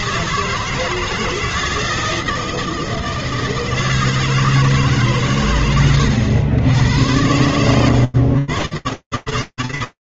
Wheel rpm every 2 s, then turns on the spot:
130, 160, 160, 140, 100.
none